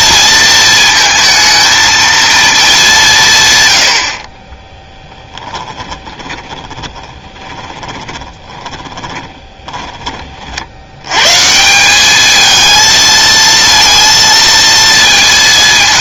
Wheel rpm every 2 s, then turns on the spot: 230, 210, 20, 20, 20, 70, 220, 230.
4-10